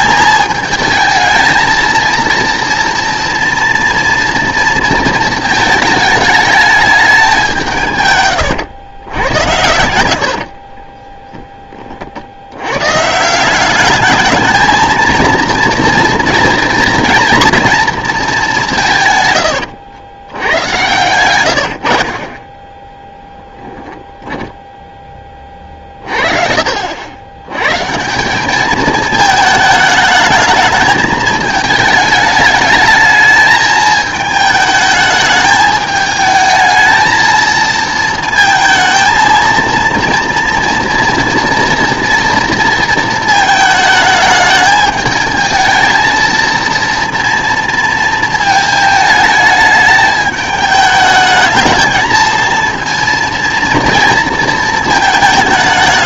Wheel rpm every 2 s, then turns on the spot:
220, 230, 230, 210, 110, 40, 120, 220, 230, 180, 100, 10, 10, 70, 210, 210, 210, 210, 220, 220, 230, 230, 220, 230, 220, 210, 230, 220.
10-12